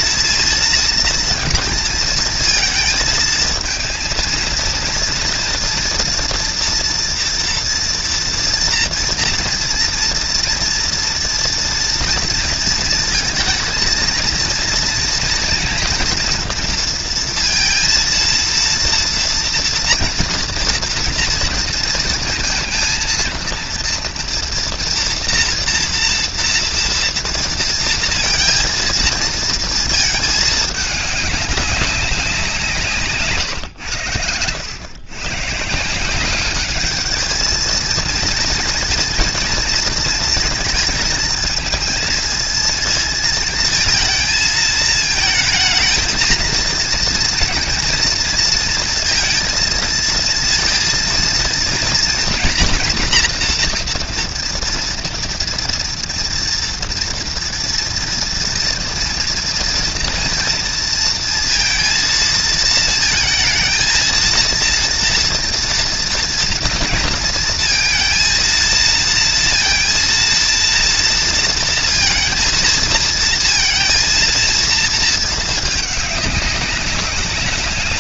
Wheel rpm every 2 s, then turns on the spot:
230, 230, 230, 240, 230, 230, 230, 230, 240, 230, 230, 230, 230, 230, 230, 210, 160, 100, 210, 230, 230, 220, 220, 230, 230, 230, 240, 230, 230, 230, 230, 230, 230, 240, 230, 230, 230, 230, 200.
none